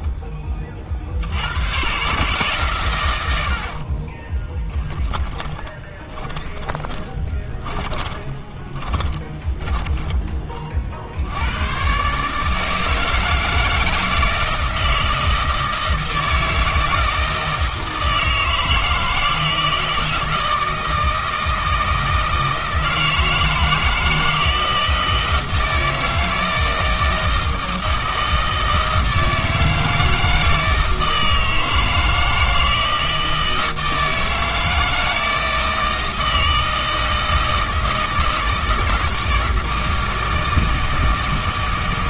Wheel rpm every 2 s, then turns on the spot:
40, 120, 10, 10, 30, 50, 160, 160, 160, 160, 160, 160, 160, 160, 160, 160, 160, 160, 160, 160, 160.
4-10